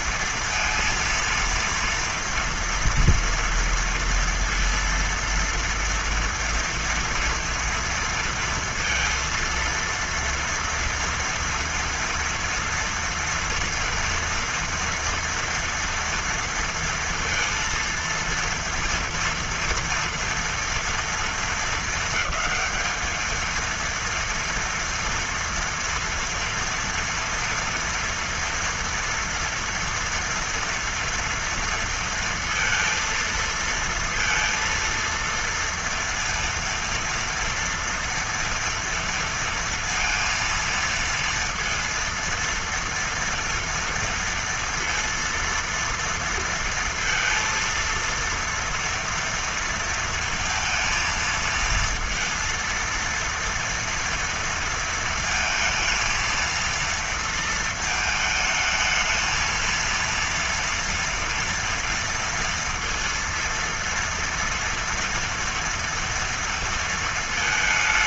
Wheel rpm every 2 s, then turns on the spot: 230, 230, 230, 230, 230, 230, 240, 230, 230, 230, 240, 220, 230, 230, 230, 230, 230, 230, 230, 230, 230, 230, 230, 230, 230, 230, 230, 230, 230, 220, 230, 230, 230, 230.
none